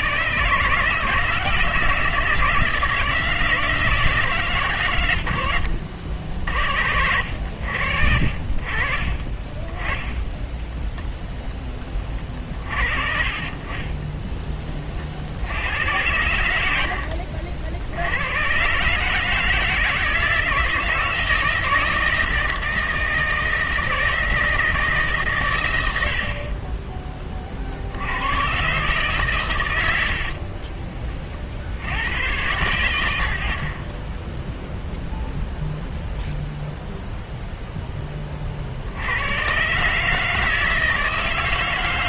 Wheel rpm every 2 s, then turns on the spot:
160, 170, 120, 70, 40, 10, 40, 30, 80, 130, 160, 160, 160, 20, 130, 40, 90, 0, 0, 60, 160.
10-12 16-18 30-32